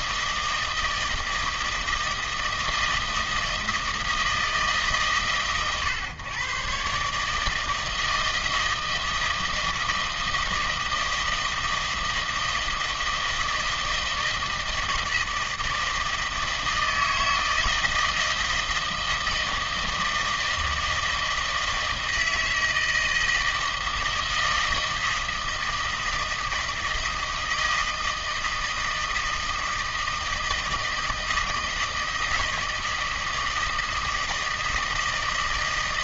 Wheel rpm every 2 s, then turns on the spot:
160, 160, 150, 130, 160, 160, 160, 160, 160, 160, 160, 160, 160, 160, 160, 160, 160, 160.
none